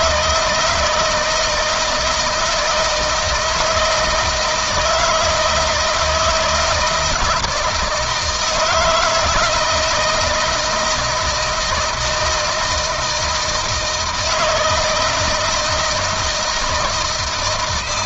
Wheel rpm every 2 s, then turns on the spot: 160, 160, 160, 170, 160, 160, 160, 160, 160.
none